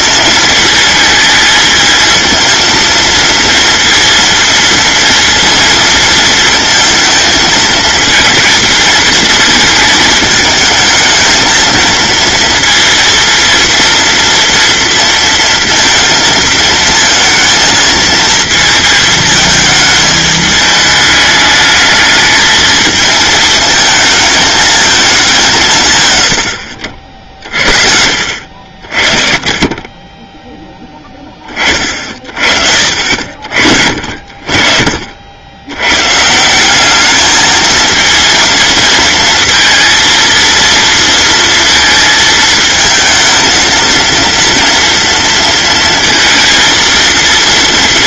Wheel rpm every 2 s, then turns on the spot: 220, 230, 230, 230, 230, 220, 230, 230, 220, 220, 210, 220, 220, 70, 50, 10, 50, 50, 200, 230, 230, 220, 230, 230.
none